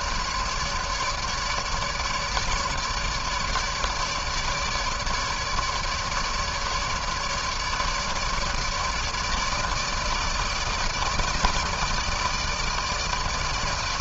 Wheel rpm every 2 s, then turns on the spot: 150, 150, 150, 150, 150, 160, 160.
none